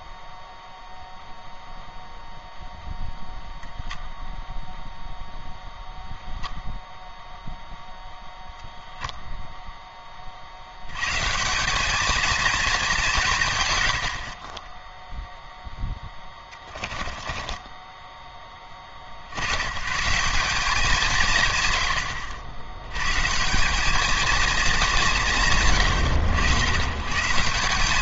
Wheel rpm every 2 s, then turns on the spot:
0, 0, 0, 0, 0, 120, 200, 10, 20, 60, 190, 100, 200, 100.
16-18